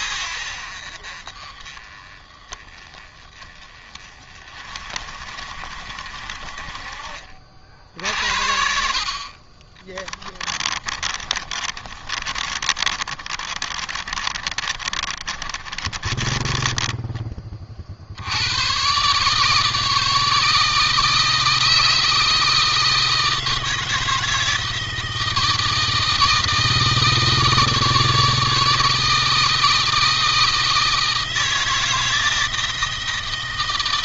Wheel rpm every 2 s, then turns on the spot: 60, 20, 40, 40, 50, 40, 30, 30, 20, 100, 150, 160, 160, 160, 160, 160, 170.
10-18